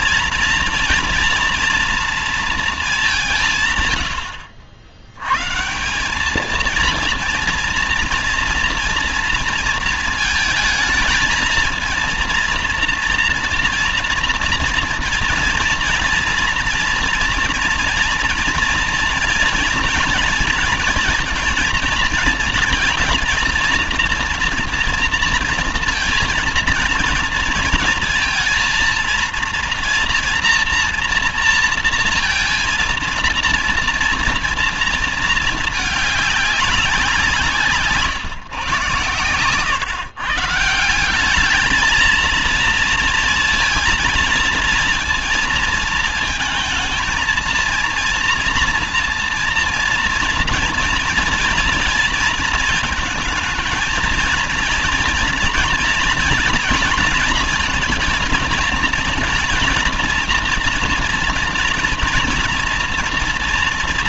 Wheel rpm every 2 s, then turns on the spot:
230, 230, 100, 220, 230, 220, 230, 230, 230, 240, 230, 220, 230, 230, 230, 230, 230, 230, 200, 120, 160, 230, 230, 220, 230, 230, 220, 230, 240, 230, 230, 230.
none